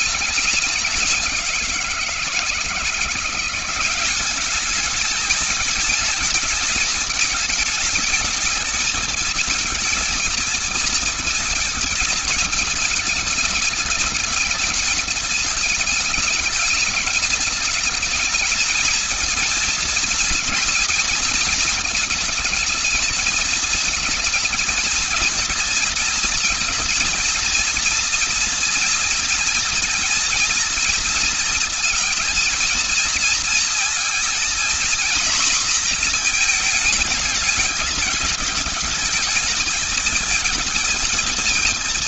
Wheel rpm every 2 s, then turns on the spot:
190, 170, 200, 220, 220, 220, 220, 210, 220, 220, 220, 220, 230, 230, 230, 230, 230, 230, 230, 220, 220.
none